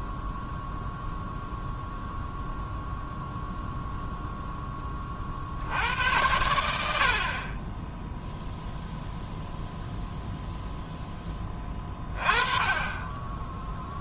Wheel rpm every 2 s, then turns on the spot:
0, 0, 10, 80, 0, 0, 20.
none